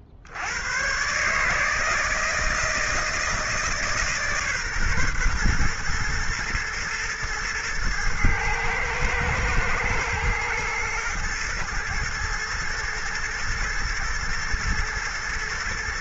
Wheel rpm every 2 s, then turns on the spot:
90, 160, 140, 120, 110, 120, 120, 120.
none